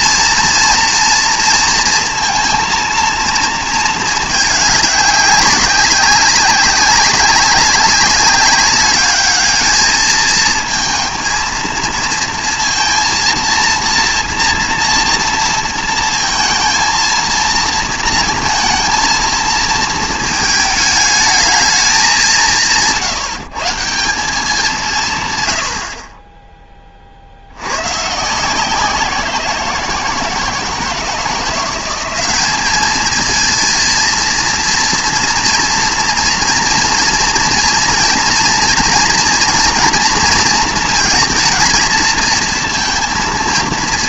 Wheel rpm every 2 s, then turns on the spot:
230, 230, 200, 200, 200, 230, 230, 230, 230, 220, 220, 160, 170, 20, 180, 160, 210, 230, 230, 230, 230, 230.
none